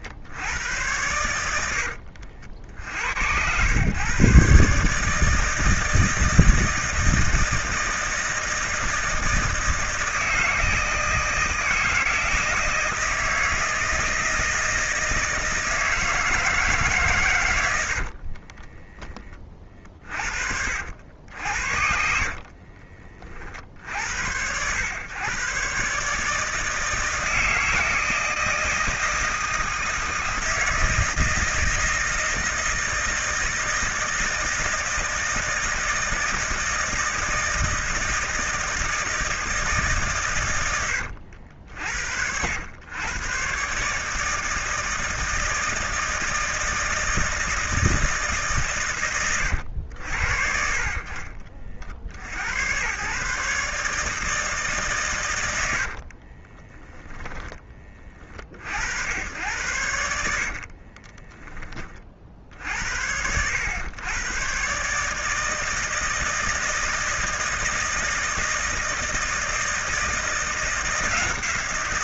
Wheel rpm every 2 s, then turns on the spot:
100, 70, 150, 160, 170, 160, 160, 160, 130, 20, 70, 40, 110, 160, 160, 160, 160, 160, 160, 160, 100, 110, 160, 160, 120, 40, 110, 140, 10, 80, 30, 70, 140, 160, 160, 170.
56-58 60-62